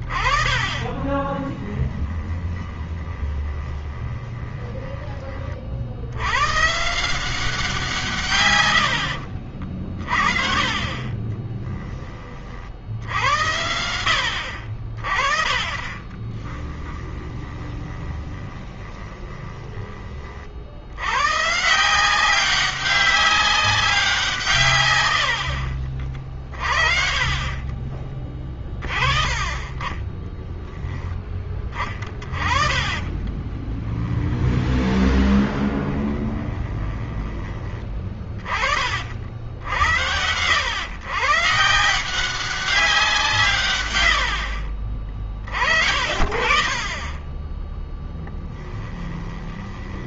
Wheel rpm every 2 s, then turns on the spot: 30, 20, 20, 160, 90, 20, 60, 50, 20, 20, 80, 190, 110, 40, 30, 10, 30, 20, 20, 40, 110, 180, 50, 30, 20.
0-4 10-12 16-20 26-30 32-38 48-50